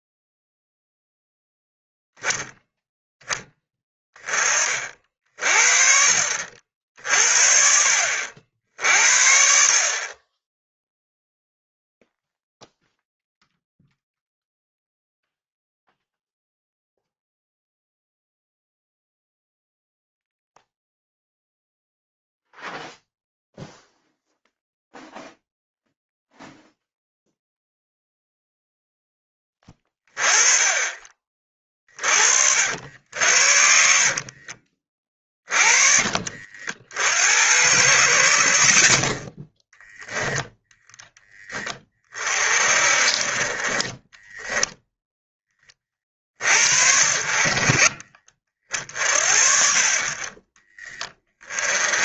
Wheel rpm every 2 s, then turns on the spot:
0, 0, 30, 50, 70, 10, 0, 0, 0, 0, 0, 0, 0, 0, 0, 20, 70, 30, 60, 40, 10, 40, 0, 50, 50, 30.
34-36 50-52